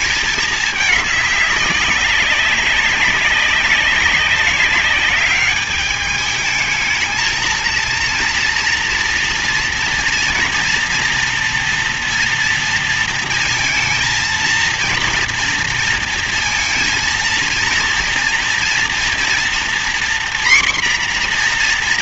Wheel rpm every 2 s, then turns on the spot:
210, 200, 200, 220, 230, 230, 230, 230, 230, 240, 250.
none